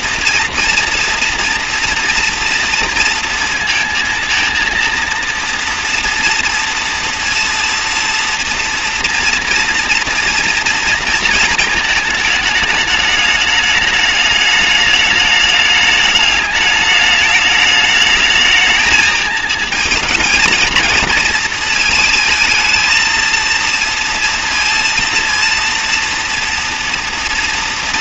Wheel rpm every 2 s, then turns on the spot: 230, 240, 230, 240, 230, 230, 210, 210, 210, 220, 230, 220, 230, 230.
none